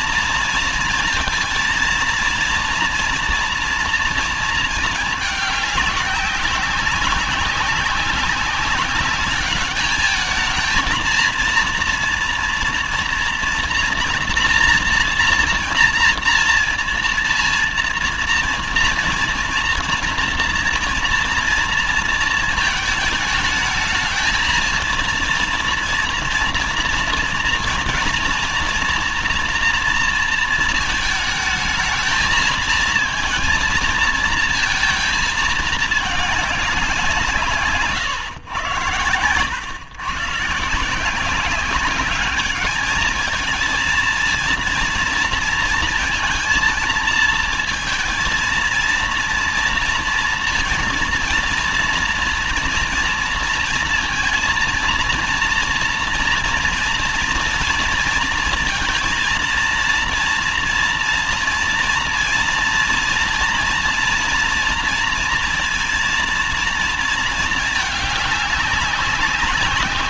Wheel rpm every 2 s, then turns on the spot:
230, 230, 230, 190, 190, 220, 230, 240, 230, 230, 240, 220, 220, 230, 230, 230, 220, 230, 190, 110, 160, 210, 230, 230, 230, 230, 230, 230, 230, 230, 230, 240, 230, 230, 200.
none